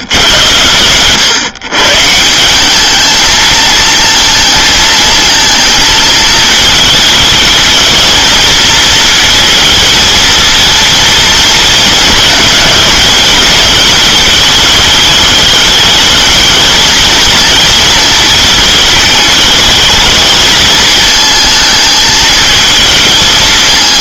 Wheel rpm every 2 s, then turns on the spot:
110, 210, 220, 210, 230, 230, 210, 210, 220, 210, 220, 220.
none